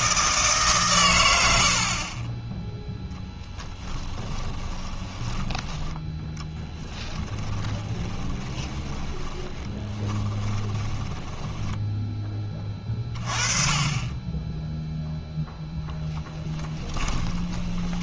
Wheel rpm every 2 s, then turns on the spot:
130, 10, 20, 10, 20, 20, 20, 0, 10.
4-12 16-18